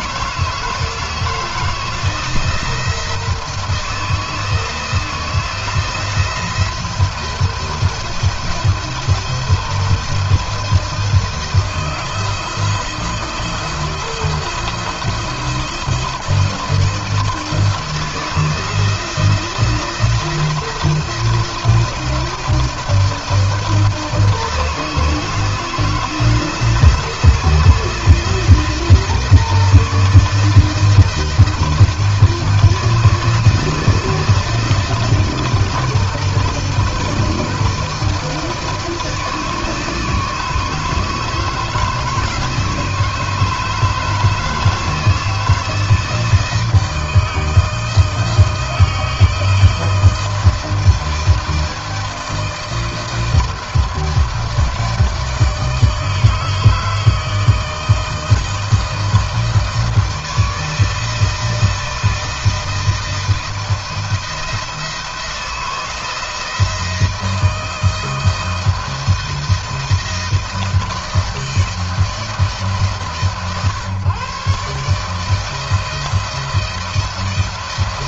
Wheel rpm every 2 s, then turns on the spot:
160, 160, 170, 170, 170, 170, 170, 170, 170, 170, 170, 170, 160, 170, 160, 160, 160, 160, 160, 160, 150, 160, 160, 160, 160, 160, 160, 160, 160, 160, 160, 160, 170, 160, 160, 160, 140, 160, 170.
none